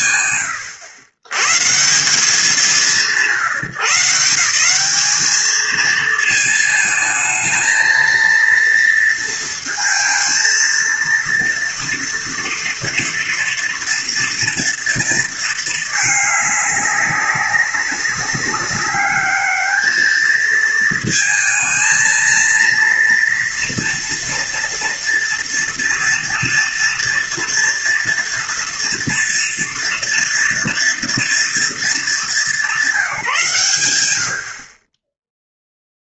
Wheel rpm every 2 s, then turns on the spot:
100, 140, 210, 230, 230, 230, 230, 220, 200, 210, 220, 230, 230, 230, 230, 230, 180, 10.
none